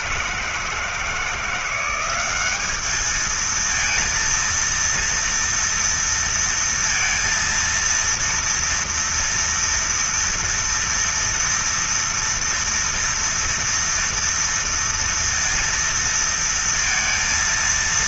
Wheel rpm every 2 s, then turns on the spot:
170, 210, 230, 230, 230, 230, 230, 230, 230.
none